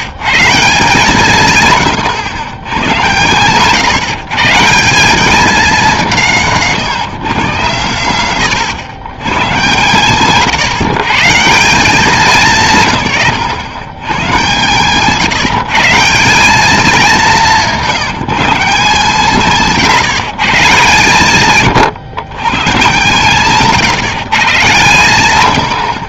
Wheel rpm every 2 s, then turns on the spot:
150, 110, 150, 170, 120, 150, 170, 130, 200, 170, 150, 140, 130.
6-8